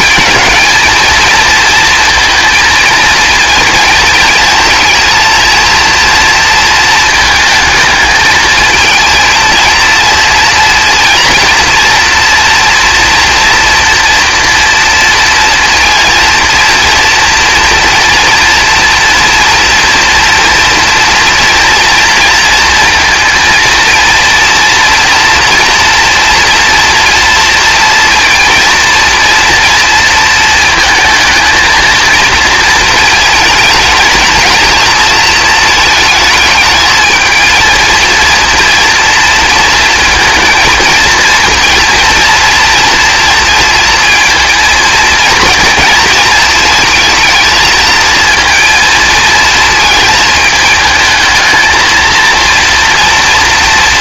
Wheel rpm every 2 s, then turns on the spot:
220, 220, 230, 230, 220, 230, 230, 240, 230, 240, 230, 230, 240, 230, 230, 220, 230, 220, 220, 230, 230, 230, 230, 220, 230, 220, 230.
none